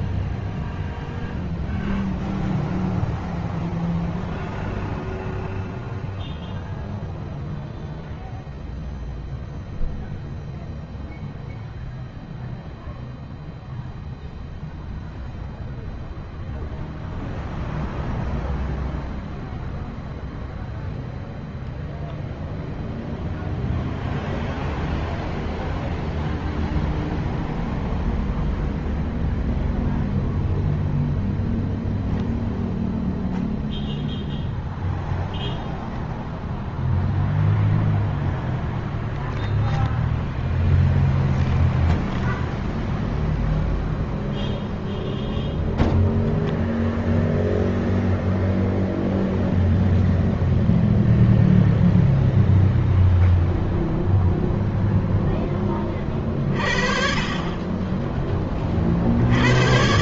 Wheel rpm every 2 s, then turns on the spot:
0, 0, 0, 0, 0, 0, 0, 0, 0, 0, 0, 0, 0, 0, 0, 10, 0, 0, 0, 0, 0, 0, 0, 0, 0, 0, 0, 30, 10, 110.
none